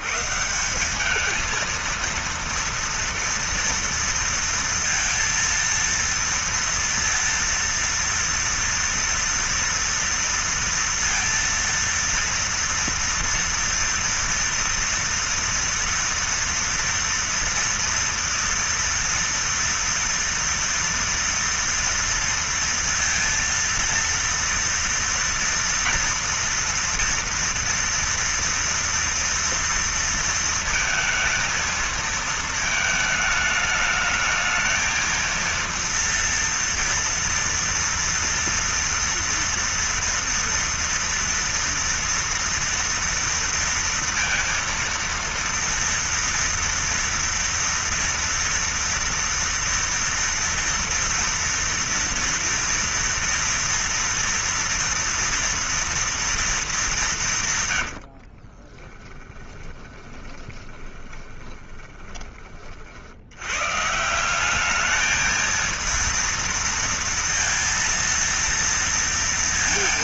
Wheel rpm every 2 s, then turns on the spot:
150, 230, 230, 230, 230, 230, 230, 230, 230, 240, 230, 230, 230, 230, 230, 230, 220, 220, 230, 230, 230, 230, 230, 230, 230, 230, 230, 230, 220, 50, 20, 40, 190, 230, 230.
58-62